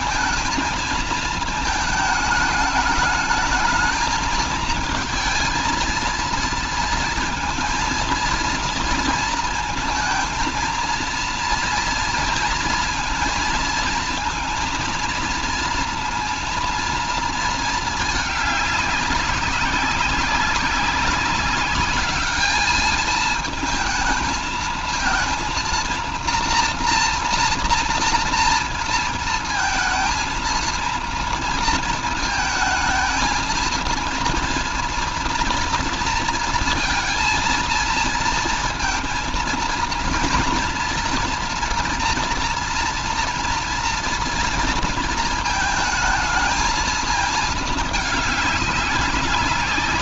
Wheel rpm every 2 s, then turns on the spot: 220, 210, 220, 230, 230, 230, 230, 230, 230, 210, 200, 220, 220, 230, 230, 230, 220, 230, 230, 230, 230, 230, 230, 220, 200.
none